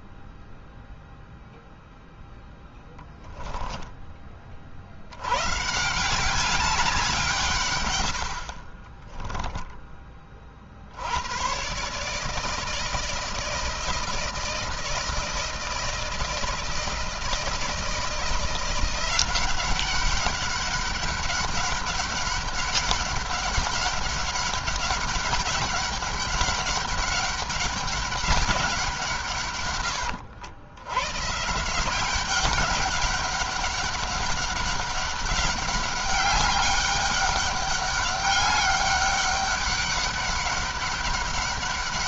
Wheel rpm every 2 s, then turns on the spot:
0, 0, 40, 190, 30, 60, 160, 160, 160, 180, 200, 200, 200, 200, 180, 110, 200, 200, 200, 200, 200.
8-10